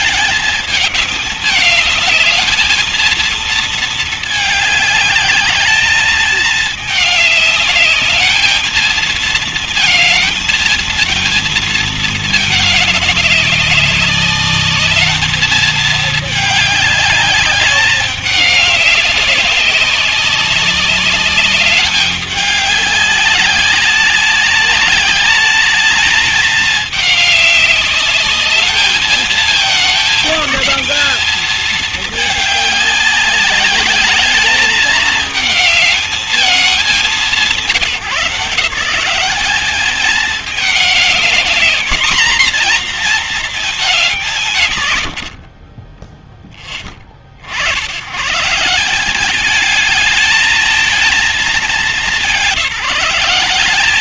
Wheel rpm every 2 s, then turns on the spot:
210, 220, 210, 210, 220, 230, 210, 210, 210, 200, 200, 200, 200, 210, 220, 220, 200, 210, 190, 190, 210, 240, 140, 30, 180, 220, 190.
44-46